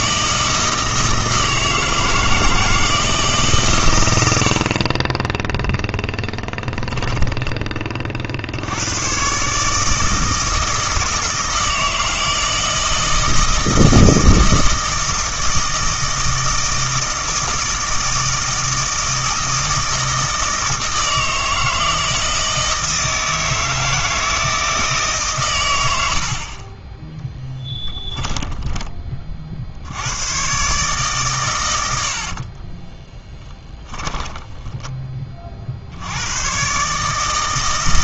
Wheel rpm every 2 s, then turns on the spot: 160, 160, 40, 10, 90, 160, 160, 160, 160, 160, 160, 160, 160, 30, 10, 130, 30, 10, 130.
6-8 32-34